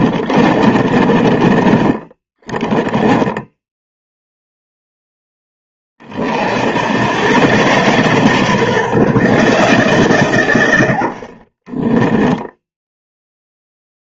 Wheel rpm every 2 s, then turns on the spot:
30, 10, 0, 90, 150, 80, 0.
0-4